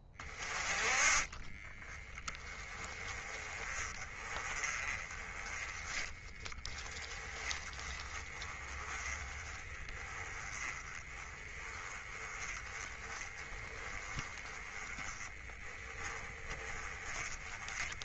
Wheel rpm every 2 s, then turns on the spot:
20, 20, 30, 20, 20, 20, 20, 20, 20.
none